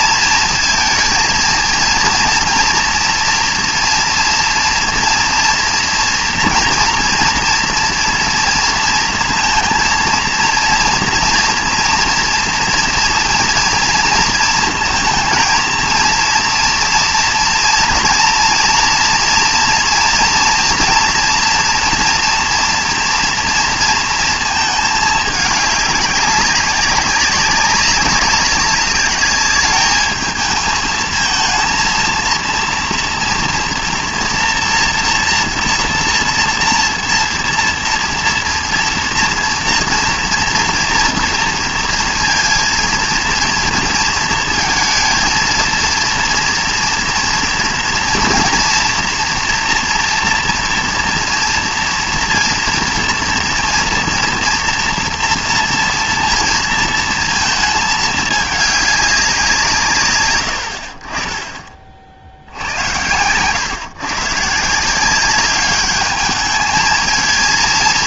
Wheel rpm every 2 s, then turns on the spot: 230, 230, 230, 230, 230, 230, 240, 230, 230, 230, 240, 230, 220, 190, 200, 220, 230, 230, 240, 240, 240, 230, 230, 230, 230, 230, 230, 230, 230, 200, 60, 90, 160, 220.
none